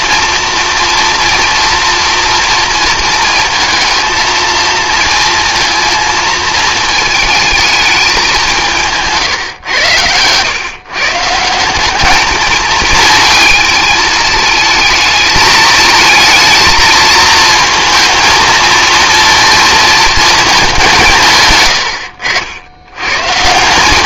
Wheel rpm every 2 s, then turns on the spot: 230, 230, 230, 220, 180, 130, 220, 220, 230, 230, 210, 80.
none